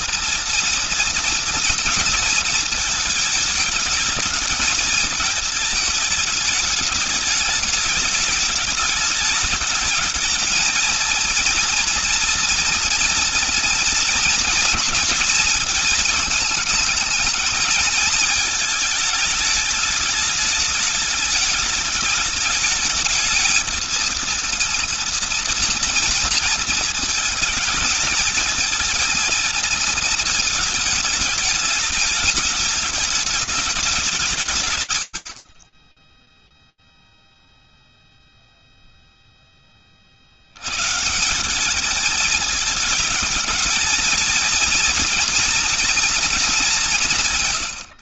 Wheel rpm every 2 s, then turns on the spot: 230, 220, 220, 210, 210, 230, 230, 230, 220, 220, 210, 210, 230, 230, 220, 220, 210, 160, 0, 0, 130, 220, 230, 200.
46-48